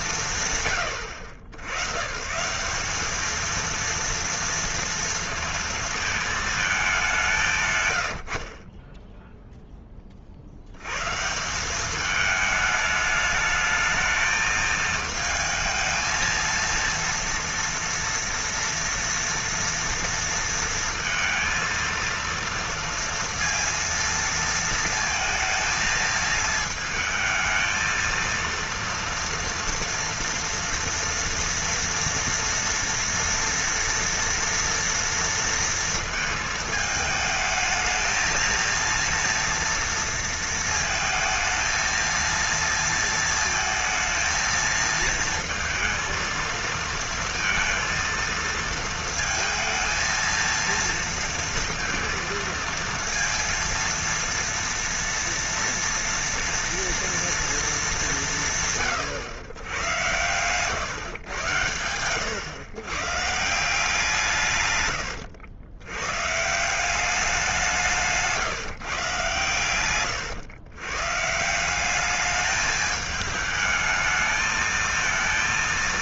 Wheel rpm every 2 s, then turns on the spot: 140, 180, 230, 220, 40, 80, 210, 220, 230, 240, 230, 230, 230, 220, 230, 240, 240, 230, 220, 230, 230, 230, 220, 230, 230, 230, 230, 230, 230, 140, 120, 120, 130, 170, 150, 110, 210, 220.
none